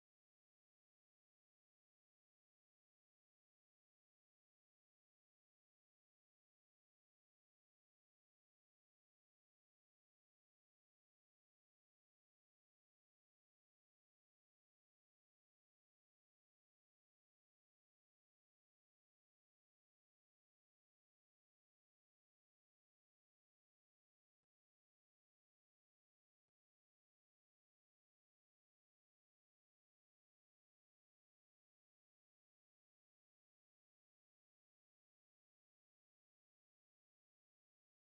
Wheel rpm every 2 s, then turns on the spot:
0, 0, 0, 0, 0, 0, 0, 0, 0, 0, 0, 0, 0, 0, 0, 0, 0, 0, 0.
none